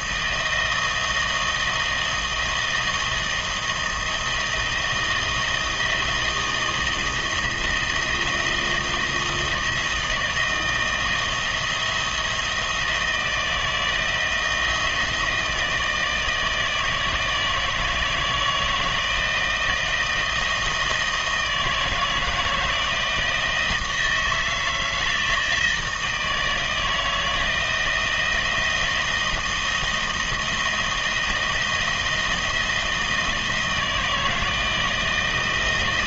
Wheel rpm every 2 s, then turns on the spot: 160, 160, 160, 160, 170, 170, 170, 160, 160, 160, 160, 160, 160, 160, 160, 160, 170, 160.
none